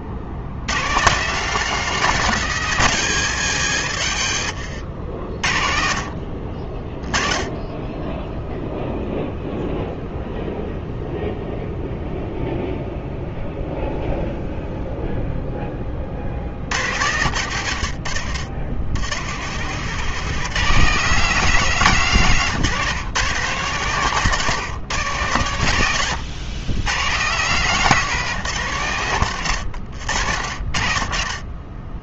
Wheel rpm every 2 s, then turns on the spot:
140, 180, 80, 30, 0, 0, 0, 0, 90, 90, 190, 150, 140, 130, 120, 50.
4-6